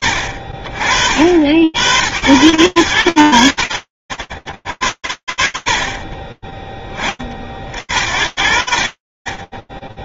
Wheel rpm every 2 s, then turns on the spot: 60, 80, 40, 40, 10.
none